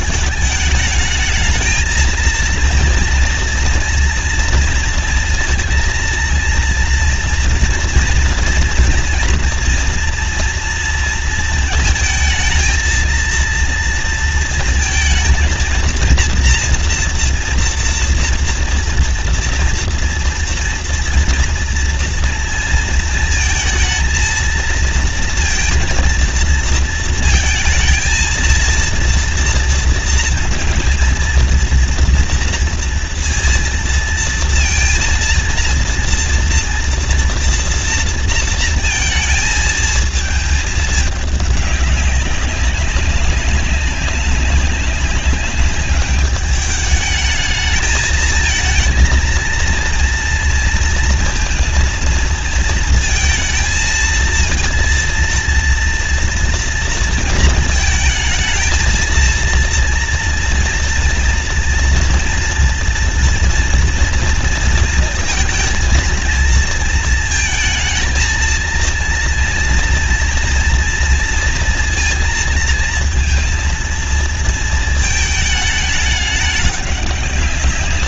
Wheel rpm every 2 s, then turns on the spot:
210, 230, 230, 230, 230, 230, 220, 230, 230, 230, 230, 230, 230, 230, 230, 230, 230, 230, 230, 230, 220, 190, 190, 210, 230, 230, 230, 230, 230, 220, 230, 230, 230, 230, 230, 230, 230, 230, 200.
none